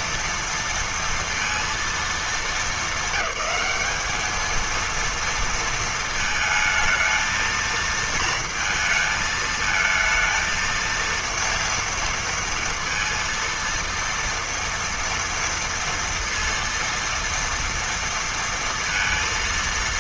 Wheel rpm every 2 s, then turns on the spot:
230, 210, 210, 220, 230, 230, 230, 230, 230, 230.
none